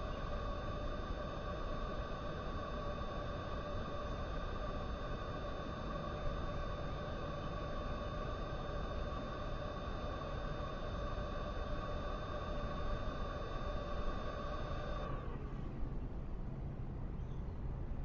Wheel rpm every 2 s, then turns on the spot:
0, 0, 0, 0, 0, 0, 0, 0, 0.
none